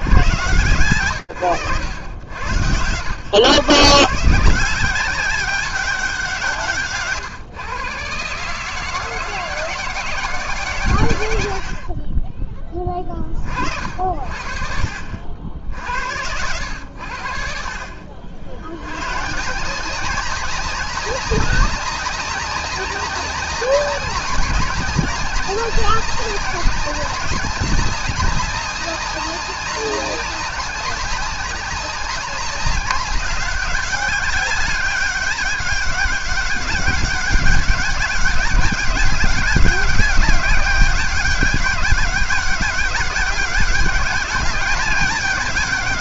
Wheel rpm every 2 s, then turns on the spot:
80, 140, 190, 130, 170, 60, 50, 70, 60, 170, 200, 190, 200, 200, 200, 200, 200, 200, 200, 190, 200, 200, 210.
none